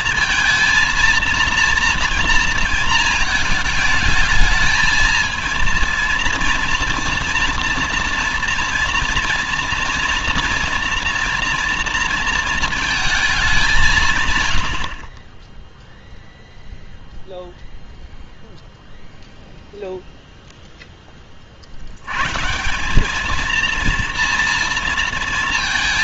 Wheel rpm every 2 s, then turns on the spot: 230, 230, 220, 230, 230, 240, 220, 80, 0, 0, 10, 180, 230.
none